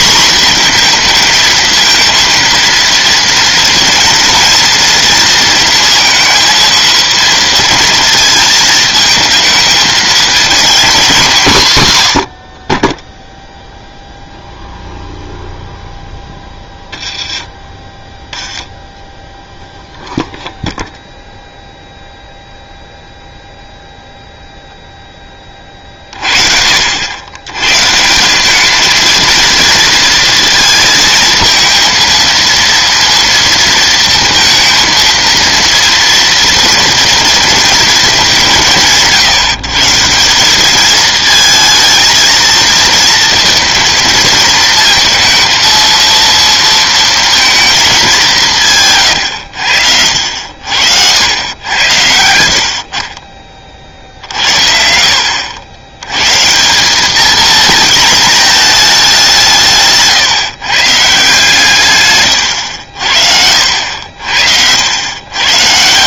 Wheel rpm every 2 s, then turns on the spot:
240, 230, 230, 230, 220, 230, 30, 0, 10, 10, 0, 0, 0, 60, 210, 230, 230, 230, 230, 160, 200, 230, 220, 230, 160, 70, 60, 60, 170, 220, 140, 90, 80.
62-64